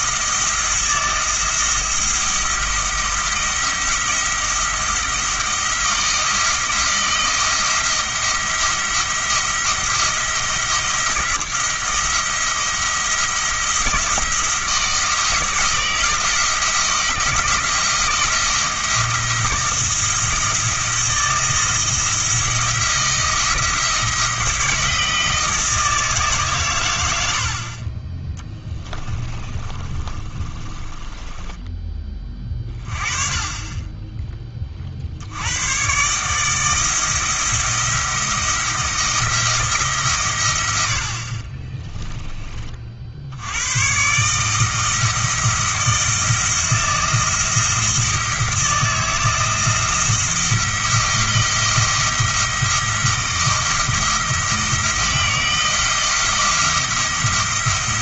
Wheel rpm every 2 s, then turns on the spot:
170, 170, 170, 170, 170, 170, 170, 160, 170, 170, 170, 170, 160, 110, 20, 20, 20, 50, 160, 170, 90, 50, 160, 170, 160, 160, 170, 170, 170.
28-32